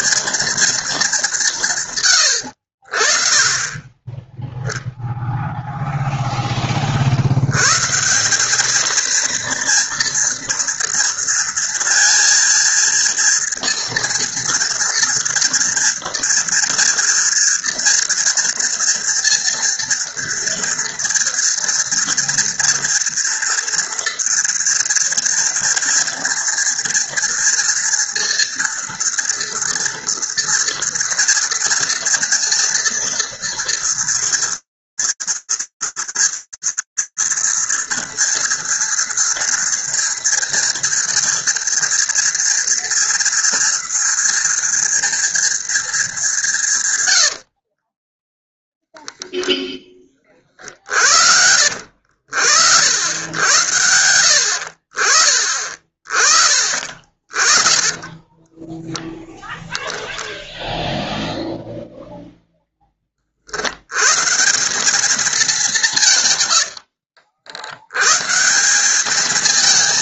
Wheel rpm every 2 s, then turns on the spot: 240, 130, 10, 0, 150, 230, 230, 230, 230, 240, 230, 240, 230, 230, 230, 230, 230, 230, 230, 230, 230, 230, 220, 20, 0, 70, 90, 40, 30, 0, 0, 80, 210, 90, 220.
46-48